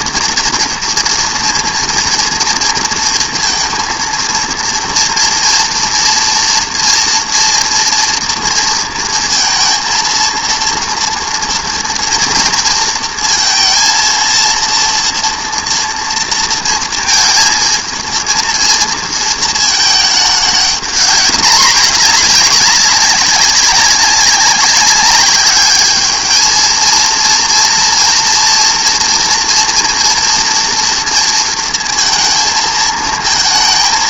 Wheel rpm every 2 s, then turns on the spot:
230, 230, 230, 230, 230, 230, 230, 230, 230, 230, 210, 200, 200, 230, 230, 230, 220.
none